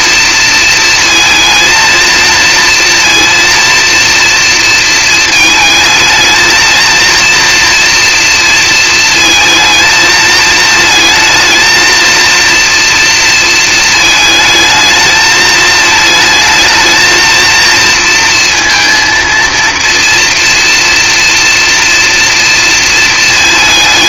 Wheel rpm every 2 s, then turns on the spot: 230, 230, 230, 220, 230, 220, 230, 220, 220, 230, 240, 230.
none